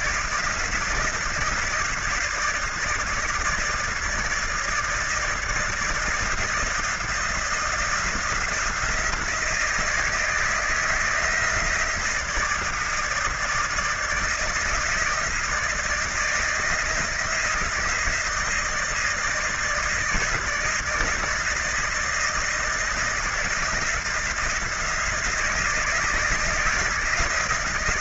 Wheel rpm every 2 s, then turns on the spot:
170, 160, 160, 170, 170, 160, 160, 160, 160, 160, 160, 170, 170, 160.
none